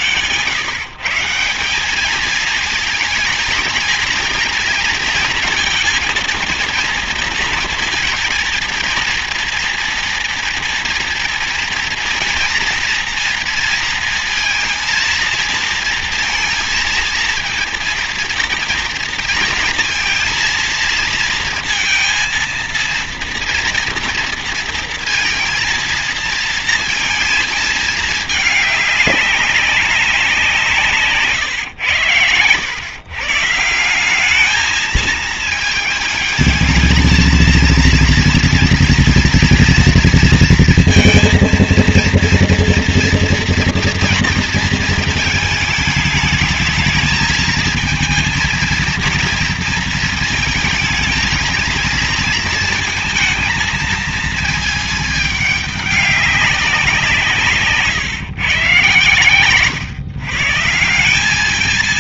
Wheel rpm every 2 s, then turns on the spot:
140, 220, 230, 230, 230, 240, 230, 230, 230, 230, 230, 230, 230, 230, 200, 160, 120, 210, 220, 230, 230, 230, 230, 220, 230, 220, 220, 220, 180, 130, 160.
none